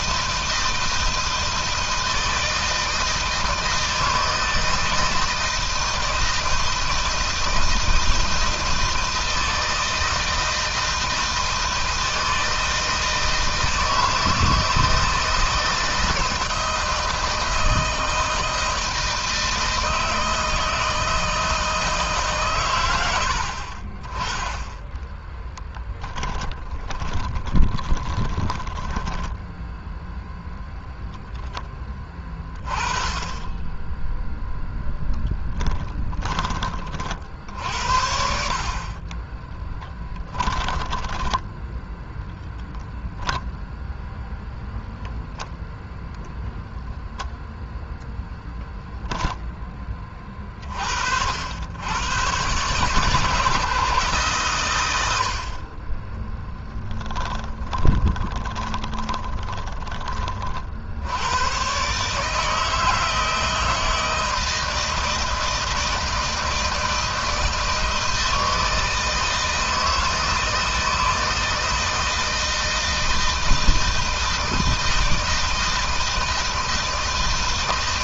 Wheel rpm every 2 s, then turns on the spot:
160, 160, 160, 160, 160, 160, 160, 160, 160, 160, 160, 110, 0, 20, 10, 0, 20, 0, 40, 30, 10, 0, 0, 0, 10, 50, 140, 100, 20, 20, 70, 160, 160, 160, 160, 160, 160, 160, 160.
26-30 38-42 48-50 56-60